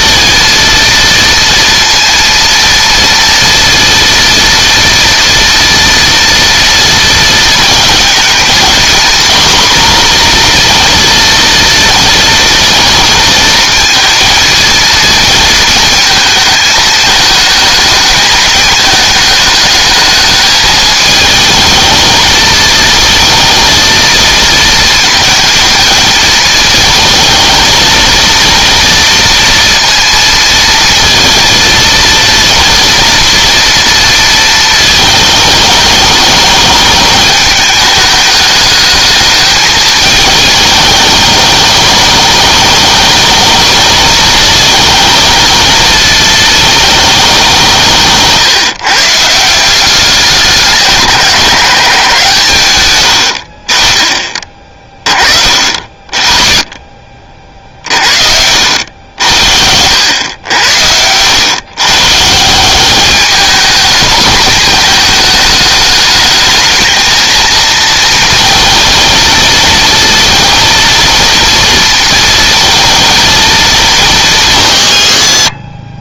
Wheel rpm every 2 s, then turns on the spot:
230, 230, 230, 230, 230, 230, 230, 230, 220, 220, 220, 230, 230, 230, 230, 230, 230, 220, 220, 210, 210, 220, 220, 220, 150, 180, 110, 30, 40, 80, 90, 190, 230, 220, 230, 230, 230, 130.
none